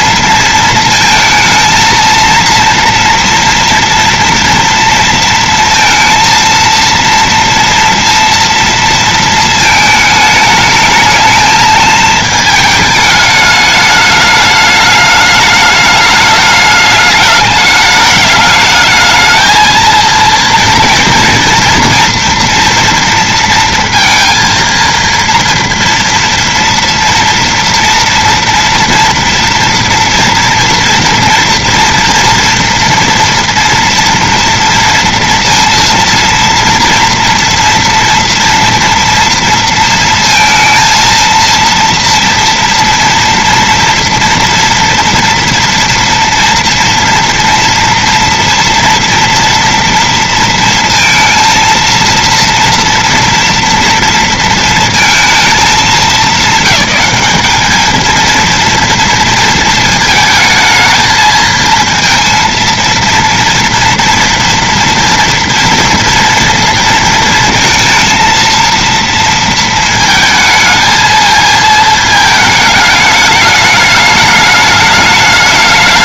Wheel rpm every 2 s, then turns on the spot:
230, 230, 230, 230, 230, 220, 220, 210, 210, 210, 230, 230, 230, 230, 240, 230, 230, 230, 230, 230, 220, 230, 240, 230, 230, 230, 230, 230, 210, 220, 220, 230, 230, 230, 230, 220, 220, 210.
none